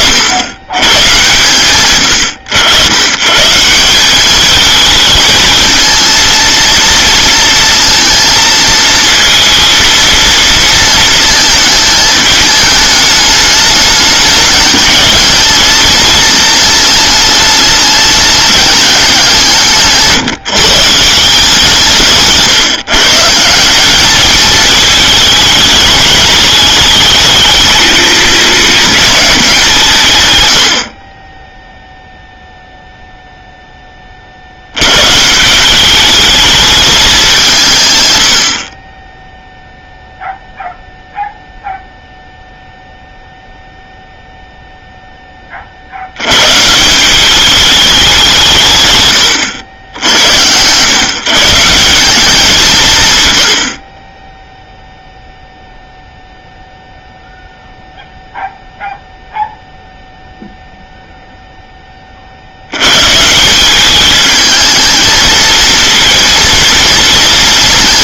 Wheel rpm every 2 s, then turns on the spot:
130, 110, 220, 230, 230, 230, 210, 200, 210, 200, 160, 140, 220, 220, 210, 40, 0, 120, 210, 40, 0, 0, 0, 170, 130, 130, 160, 0, 0, 0, 0, 110, 220, 230.
none